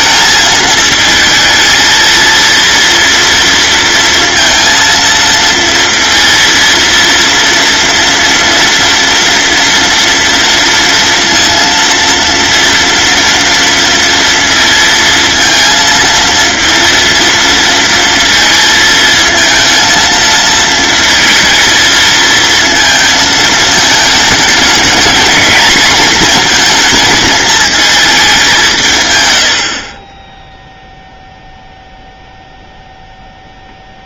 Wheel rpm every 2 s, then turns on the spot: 220, 240, 230, 230, 230, 230, 230, 230, 230, 220, 220, 220, 220, 230, 150, 0, 0.
none